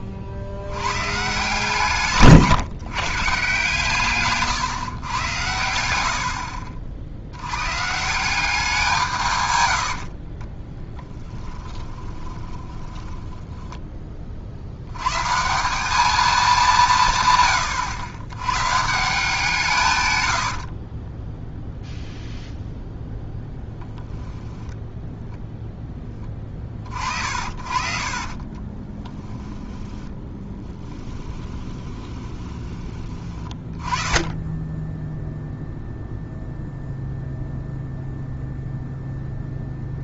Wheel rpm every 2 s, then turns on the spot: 60, 140, 130, 60, 180, 20, 10, 80, 200, 130, 50, 0, 0, 30, 30, 20, 20, 10, 0, 0.
10-14 20-22 28-32